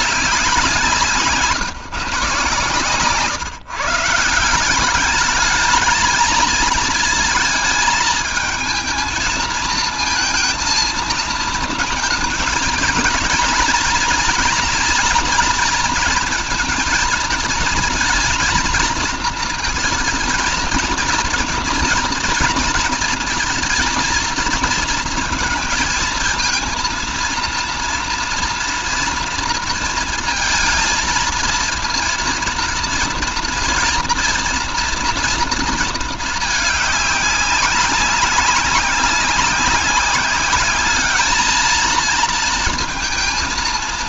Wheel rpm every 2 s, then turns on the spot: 170, 130, 180, 220, 220, 220, 230, 230, 230, 230, 230, 230, 220, 230, 230, 230, 230, 240, 210, 190, 200, 230.
none